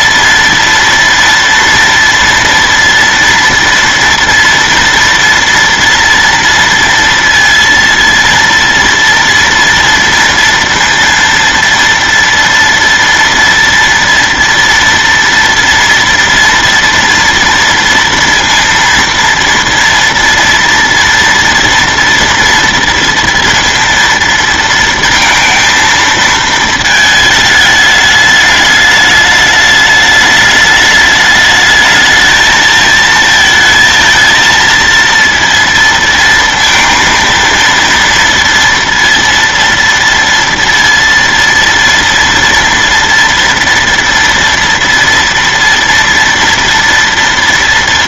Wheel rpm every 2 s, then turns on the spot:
230, 230, 230, 230, 230, 230, 230, 230, 230, 230, 230, 230, 230, 220, 210, 210, 220, 230, 230, 230, 230, 230, 230, 230.
none